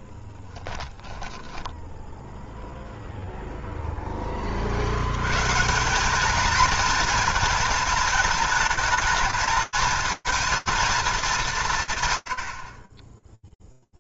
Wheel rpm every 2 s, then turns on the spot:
10, 0, 90, 230, 220, 230, 40.
none